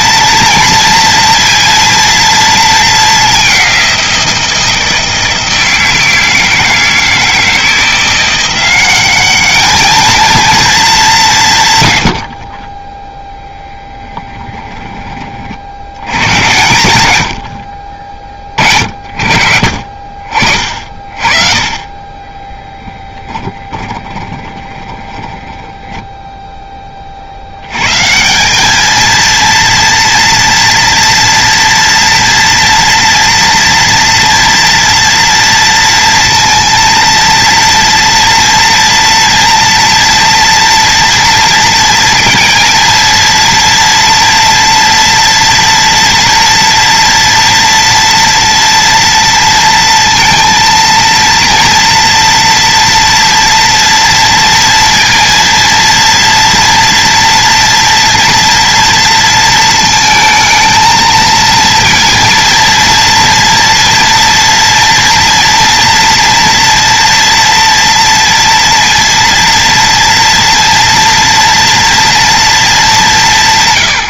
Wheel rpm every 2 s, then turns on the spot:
240, 220, 170, 160, 190, 220, 20, 20, 100, 40, 50, 10, 20, 30, 210, 230, 230, 230, 230, 240, 230, 230, 230, 230, 230, 230, 230, 230, 240, 230, 220, 230, 240, 230, 230, 230, 200.
12-14 22-26